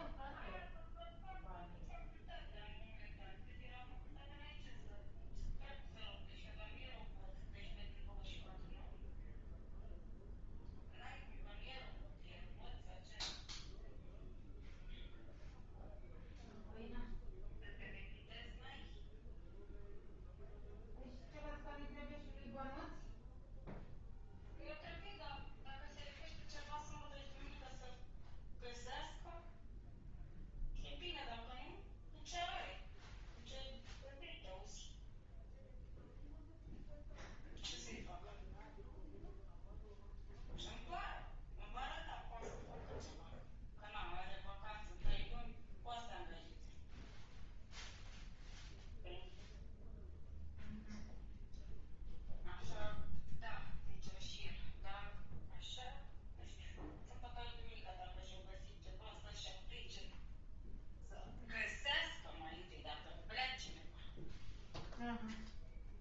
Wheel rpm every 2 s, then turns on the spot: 0, 0, 0, 0, 0, 0, 0, 0, 0, 0, 0, 0, 0, 0, 0, 0, 0, 0, 0, 0, 0, 0, 0, 0, 0, 0, 0, 0, 0, 0, 0, 0, 0.
none